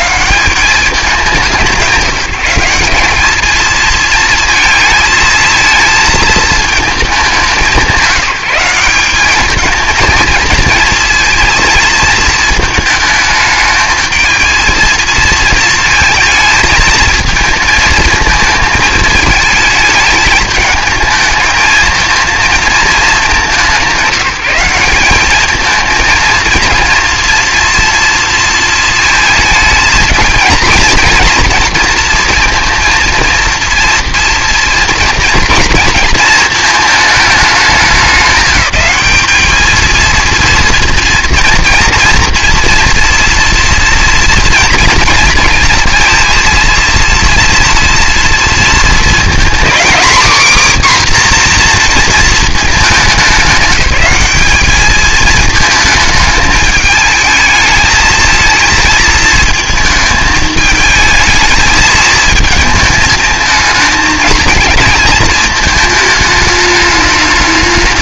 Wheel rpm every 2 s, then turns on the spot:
200, 190, 220, 220, 190, 230, 220, 230, 220, 220, 220, 220, 180, 230, 230, 230, 230, 230, 220, 210, 230, 240, 230, 230, 230, 270, 220, 210, 220, 220, 220, 220, 230, 210.
none